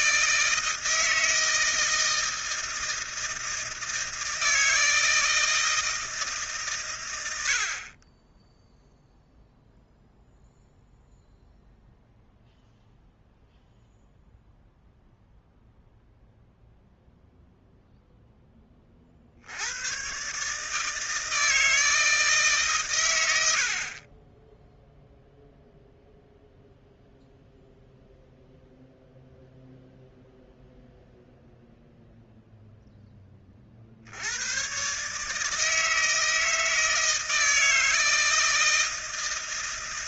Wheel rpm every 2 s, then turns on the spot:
160, 160, 160, 130, 0, 0, 0, 0, 0, 30, 160, 120, 0, 0, 0, 0, 0, 130, 160, 160.
none